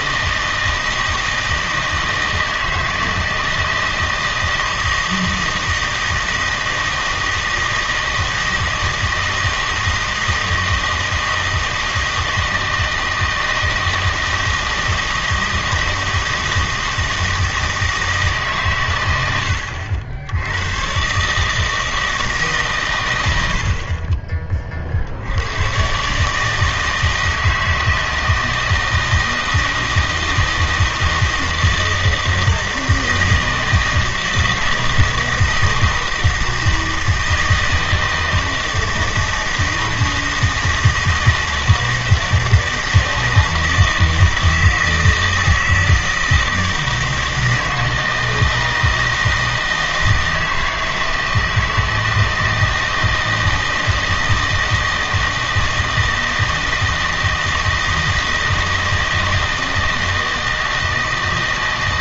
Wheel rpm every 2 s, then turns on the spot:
160, 160, 160, 160, 160, 160, 160, 160, 160, 120, 110, 130, 40, 160, 160, 160, 160, 160, 160, 160, 160, 160, 160, 160, 160, 160, 160, 160, 160, 160, 160.
none